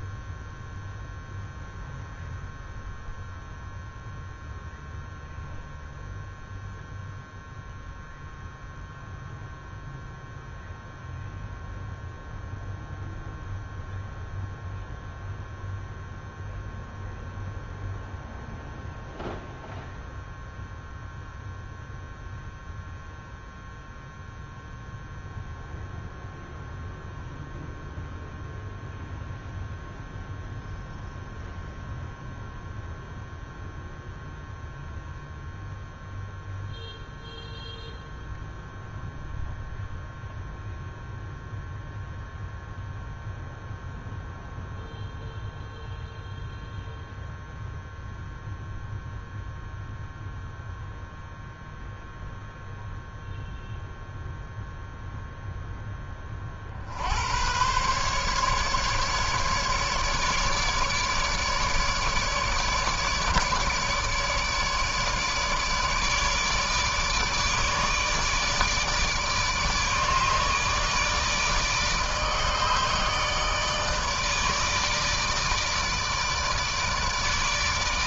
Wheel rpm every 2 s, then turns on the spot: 0, 0, 0, 0, 0, 0, 0, 0, 0, 0, 0, 0, 0, 0, 0, 0, 0, 0, 0, 0, 0, 0, 0, 0, 0, 0, 0, 0, 50, 140, 150, 150, 150, 150, 150, 150, 150, 150, 150.
none